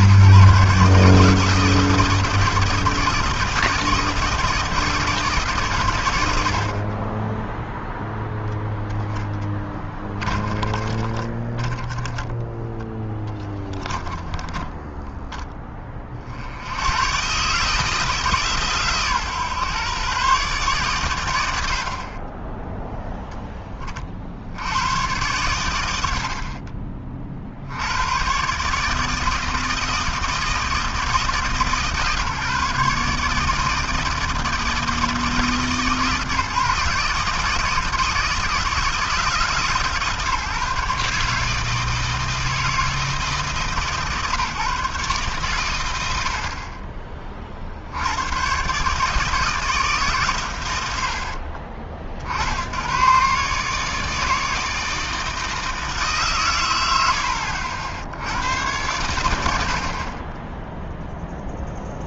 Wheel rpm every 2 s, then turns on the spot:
160, 160, 150, 20, 10, 10, 10, 20, 140, 140, 80, 10, 120, 70, 160, 150, 160, 150, 160, 140, 150, 150, 130, 50, 160, 60, 140, 160, 70, 90, 0.
8-14